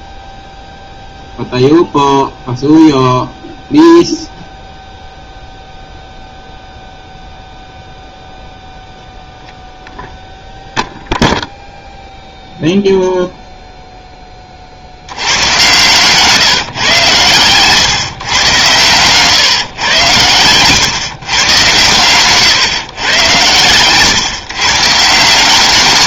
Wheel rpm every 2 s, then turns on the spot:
0, 0, 0, 0, 0, 0, 0, 40, 150, 120, 120, 130, 140.
none